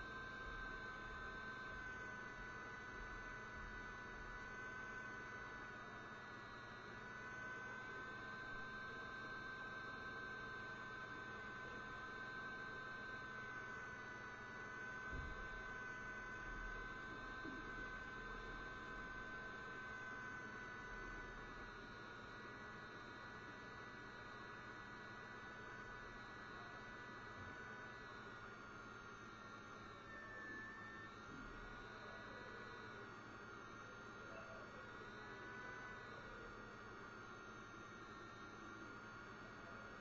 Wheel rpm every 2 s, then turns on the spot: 0, 0, 0, 0, 0, 0, 0, 0, 0, 0, 0, 0, 0, 0, 0, 0, 0, 0, 0, 0.
none